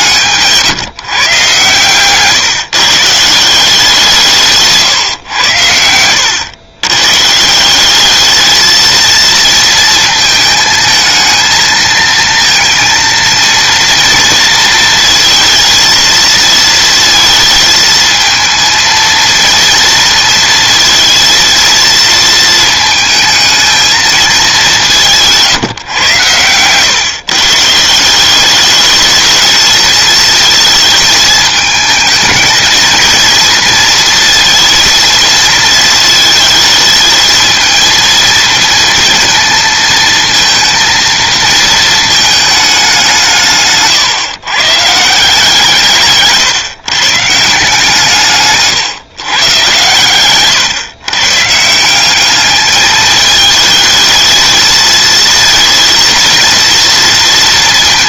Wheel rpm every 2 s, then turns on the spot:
150, 140, 150, 110, 220, 220, 230, 230, 230, 230, 230, 220, 180, 120, 210, 220, 230, 230, 220, 230, 230, 190, 150, 140, 150, 120, 210, 230, 230.
none